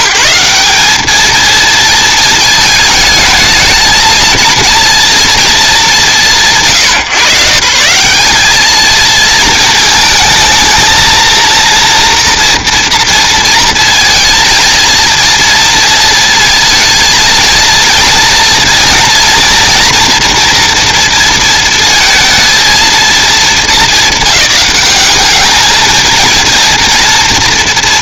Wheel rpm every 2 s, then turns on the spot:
190, 220, 230, 120, 210, 220, 230, 230, 230, 230, 240, 230, 200, 230.
none